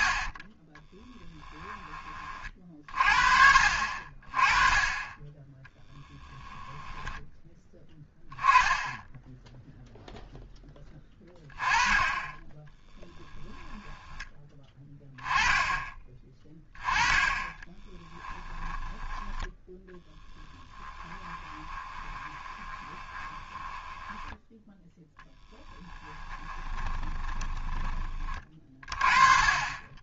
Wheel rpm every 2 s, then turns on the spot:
20, 40, 30, 10, 10, 10, 10, 20, 20, 10, 10, 20, 0, 20, 40.
0-2 6-8 12-14 18-24 26-28